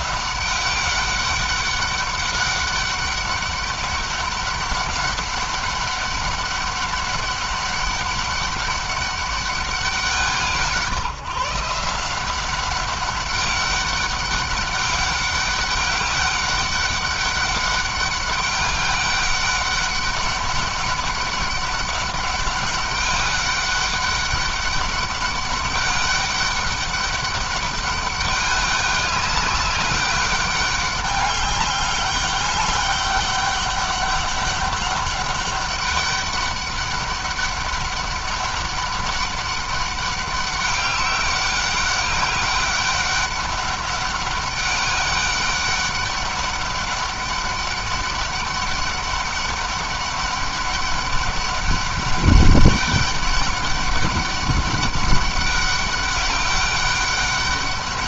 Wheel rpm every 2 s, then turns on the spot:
190, 200, 200, 200, 200, 160, 190, 200, 200, 200, 190, 200, 200, 200, 200, 200, 200, 200, 200, 200, 200, 200, 200, 200, 200, 200, 200, 200, 200.
none